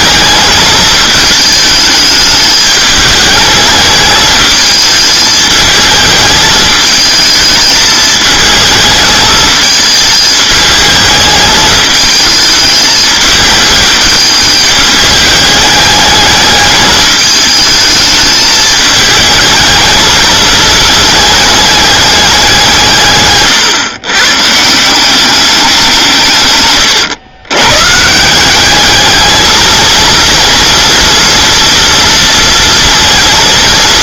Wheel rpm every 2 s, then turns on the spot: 220, 210, 220, 220, 220, 210, 220, 210, 210, 220, 220, 170, 160, 130, 200, 230, 230.
26-28